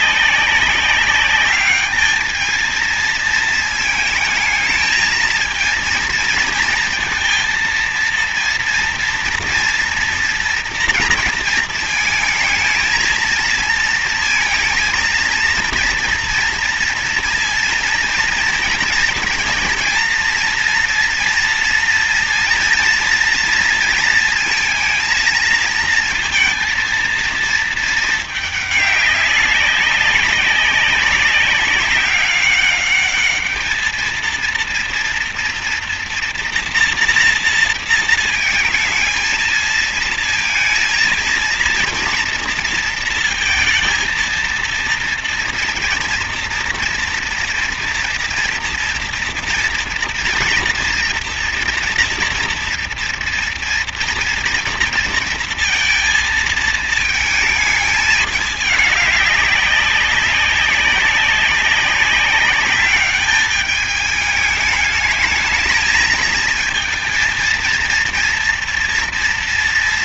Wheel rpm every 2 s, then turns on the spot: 200, 220, 220, 220, 240, 230, 220, 230, 230, 230, 230, 230, 230, 230, 210, 190, 200, 230, 230, 230, 230, 230, 230, 240, 240, 240, 230, 230, 220, 210, 190, 200, 210, 220, 230.
none